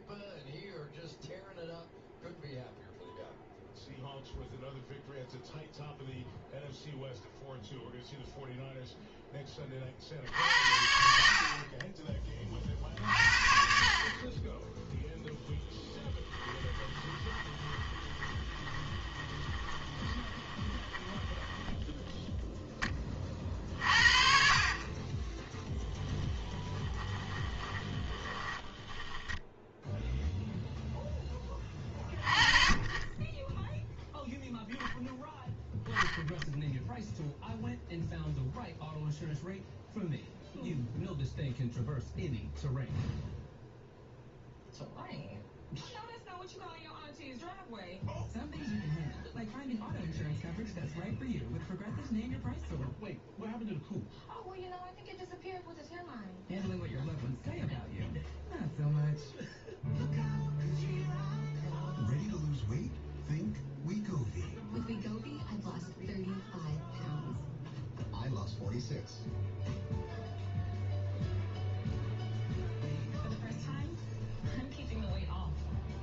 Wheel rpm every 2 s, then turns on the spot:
0, 0, 0, 0, 0, 50, 50, 10, 20, 20, 20, 10, 40, 10, 10, 0, 30, 0, 0, 0, 0, 0, 0, 0, 0, 0, 0, 0, 0, 0, 0, 0, 0, 0, 0, 0, 0, 0.
16-22 26-30